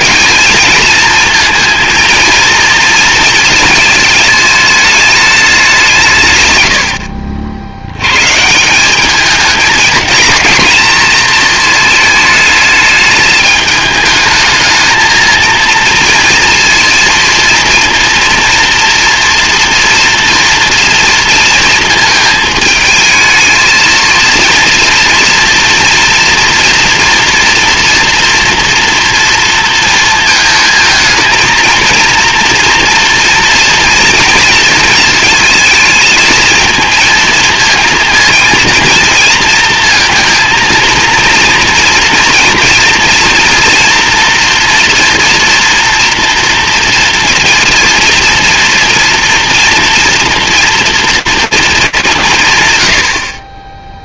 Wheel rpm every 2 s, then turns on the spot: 220, 230, 210, 70, 170, 220, 220, 220, 230, 230, 230, 220, 230, 230, 240, 220, 230, 230, 230, 230, 230, 230, 230, 230, 230, 230, 110.
none